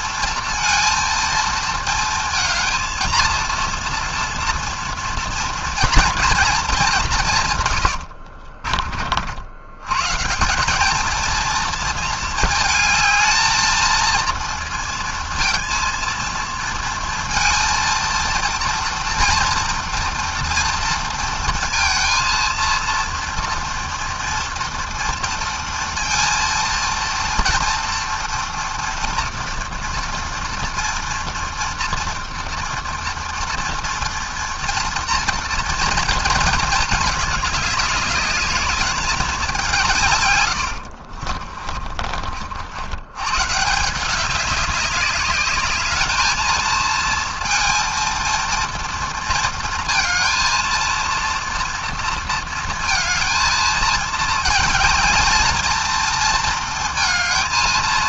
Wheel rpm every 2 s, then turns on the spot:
230, 230, 230, 170, 70, 230, 220, 230, 230, 230, 230, 230, 230, 230, 230, 230, 230, 230, 210, 200, 50, 140, 200, 230, 230, 230, 230, 220, 230.
40-42